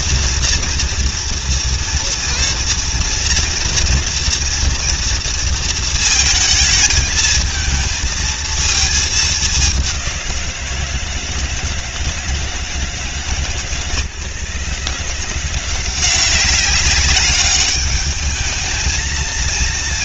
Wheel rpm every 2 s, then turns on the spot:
230, 230, 230, 220, 220, 170, 160, 150, 190, 220.
none